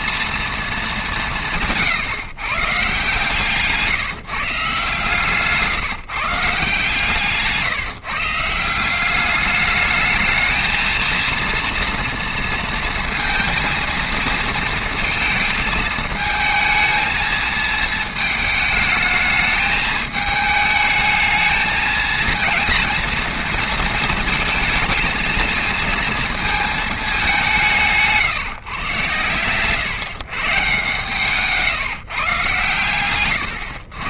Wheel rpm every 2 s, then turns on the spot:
230, 150, 160, 160, 160, 220, 230, 230, 220, 220, 220, 230, 220, 230, 150, 140, 130.
none